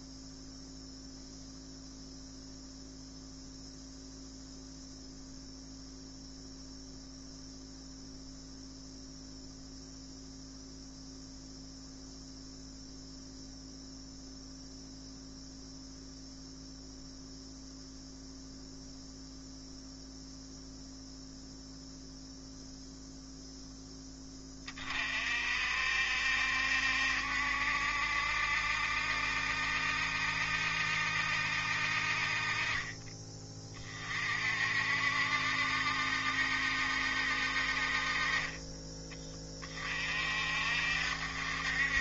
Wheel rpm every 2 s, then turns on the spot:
0, 0, 0, 0, 0, 0, 0, 0, 0, 0, 0, 0, 30, 70, 70, 70, 30, 60, 70, 30, 60.
none